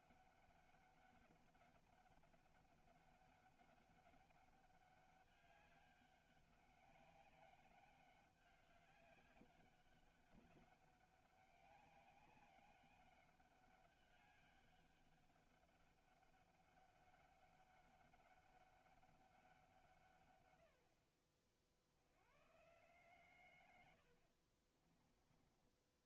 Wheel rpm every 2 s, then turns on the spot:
200, 200, 200, 200, 200, 200, 200, 200, 200, 190, 90, 130, 40.
24-26